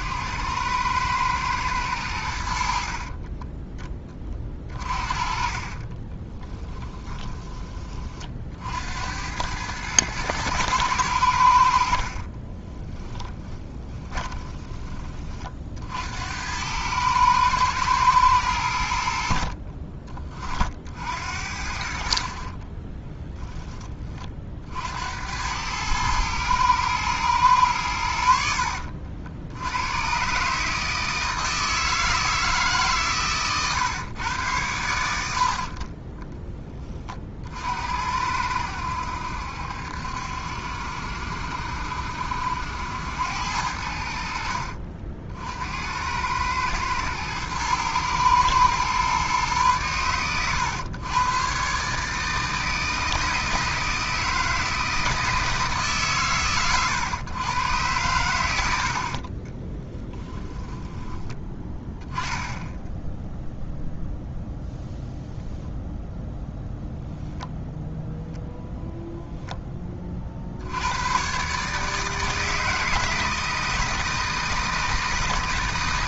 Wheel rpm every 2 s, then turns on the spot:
100, 70, 30, 10, 60, 110, 20, 20, 100, 100, 50, 30, 60, 110, 60, 150, 150, 100, 10, 80, 70, 80, 60, 110, 120, 110, 160, 160, 120, 80, 10, 10, 0, 0, 0, 80, 160, 160.
6-8 12-14 22-24